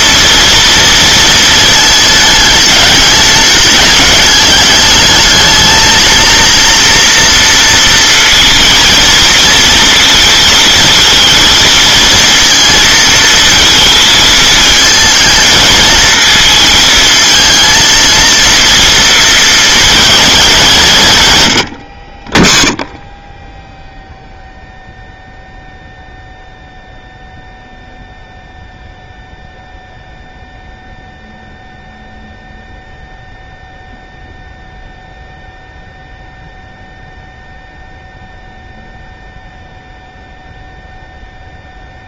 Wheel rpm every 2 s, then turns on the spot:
230, 210, 210, 230, 230, 230, 230, 220, 220, 230, 200, 20, 0, 0, 0, 0, 0, 0, 0, 0, 0.
none